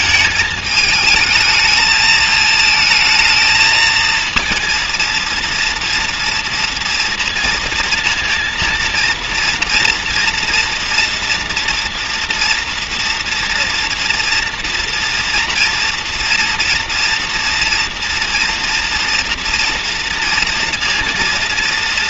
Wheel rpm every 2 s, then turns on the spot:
220, 220, 230, 230, 230, 230, 240, 230, 230, 230, 230.
none